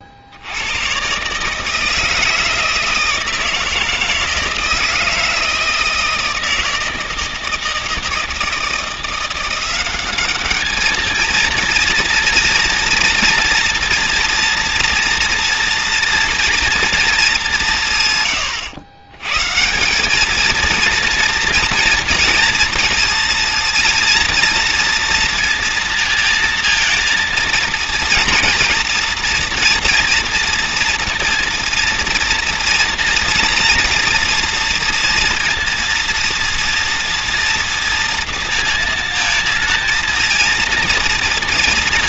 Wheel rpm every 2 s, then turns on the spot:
110, 160, 160, 160, 170, 220, 230, 230, 230, 100, 230, 230, 230, 230, 230, 240, 240, 230, 240, 230, 230.
none